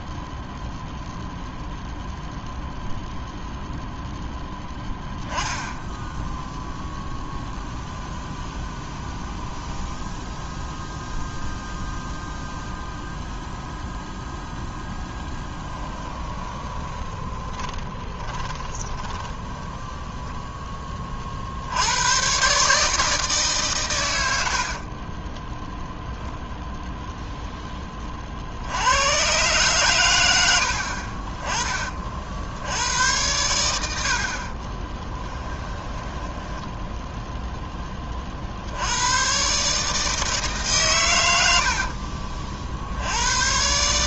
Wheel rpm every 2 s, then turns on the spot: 0, 0, 10, 0, 0, 0, 0, 20, 20, 20, 20, 150, 50, 0, 90, 60, 80, 20, 10, 80, 130, 70.
14-20 24-26 30-32 34-38